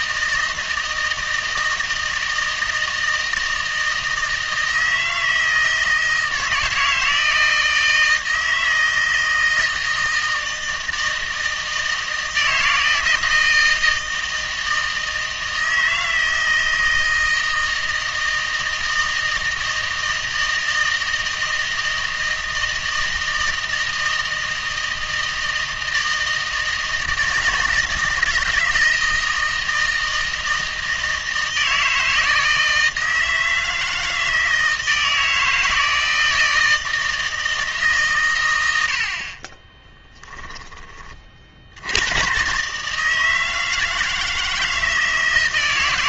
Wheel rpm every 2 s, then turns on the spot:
160, 160, 160, 160, 160, 160, 160, 160, 160, 160, 160, 160, 160, 160, 160, 160, 160, 160, 160, 90, 20, 140, 160.
none